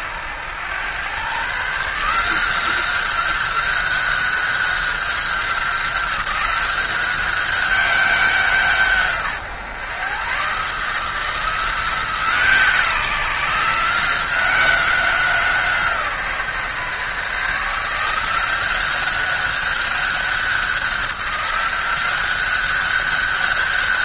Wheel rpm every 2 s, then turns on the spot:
100, 180, 190, 190, 160, 150, 160, 180, 150, 180, 190, 190.
none